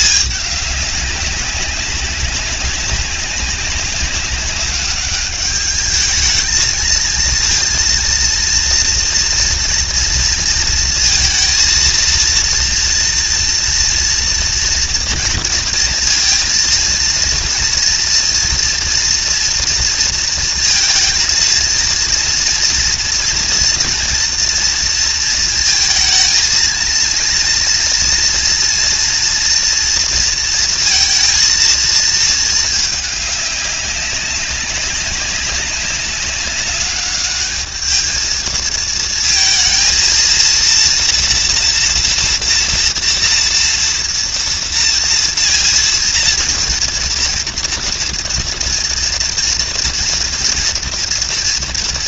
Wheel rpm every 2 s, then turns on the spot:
200, 190, 200, 220, 230, 230, 230, 230, 230, 230, 230, 230, 230, 230, 230, 230, 210, 200, 210, 230, 230, 230, 230, 230, 240, 230.
none